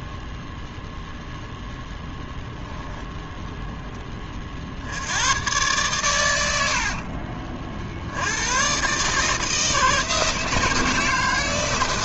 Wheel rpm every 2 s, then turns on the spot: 0, 0, 80, 50, 130, 160.
6-8